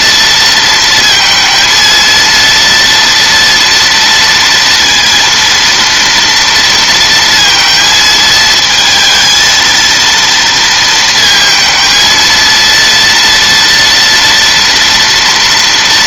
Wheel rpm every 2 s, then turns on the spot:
230, 230, 230, 230, 220, 230, 230, 240.
none